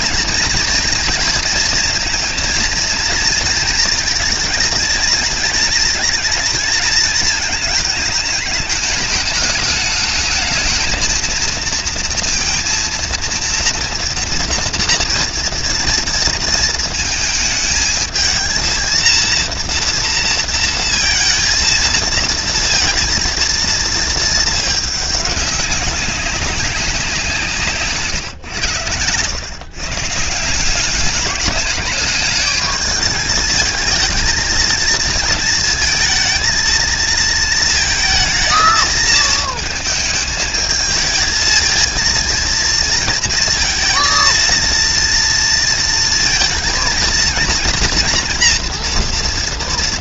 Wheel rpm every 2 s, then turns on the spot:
230, 230, 230, 220, 210, 220, 230, 230, 230, 230, 230, 230, 210, 180, 110, 200, 220, 220, 230, 220, 220, 230, 230, 230, 240.
none